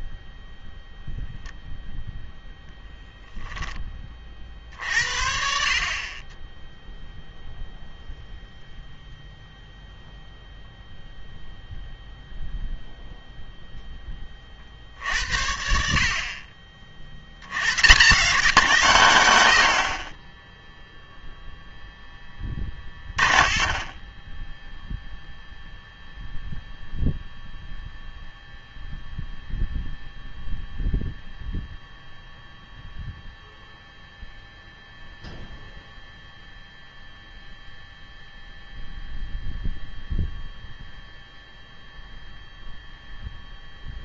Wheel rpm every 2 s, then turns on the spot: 0, 0, 60, 0, 0, 0, 0, 60, 50, 150, 0, 10, 0, 0, 0, 0, 0, 0, 0, 0, 0, 0.
none